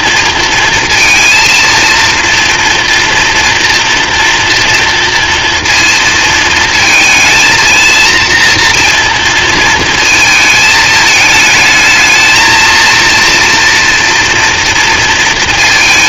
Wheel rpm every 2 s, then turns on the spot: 230, 230, 230, 220, 230, 220, 220, 230.
none